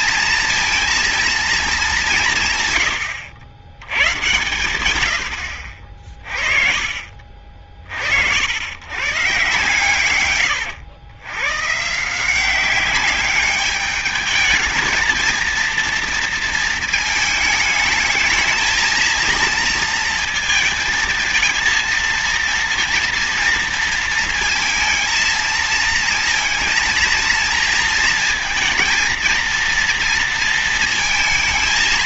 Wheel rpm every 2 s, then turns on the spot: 230, 120, 100, 40, 110, 110, 190, 220, 220, 220, 230, 230, 230, 230, 230, 230.
none